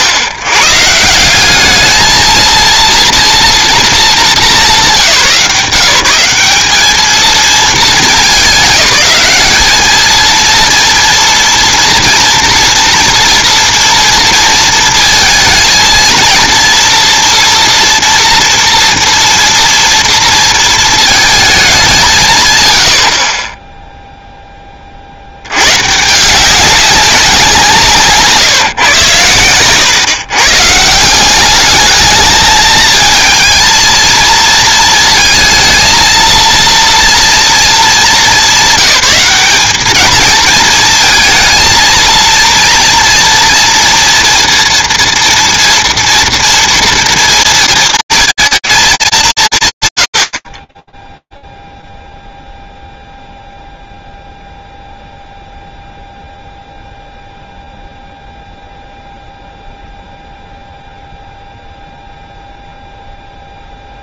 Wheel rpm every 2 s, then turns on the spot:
100, 230, 170, 210, 190, 230, 230, 230, 230, 230, 230, 130, 10, 180, 150, 140, 220, 230, 230, 180, 220, 230, 230, 230, 220, 40, 0, 0, 0, 0, 0, 0.
none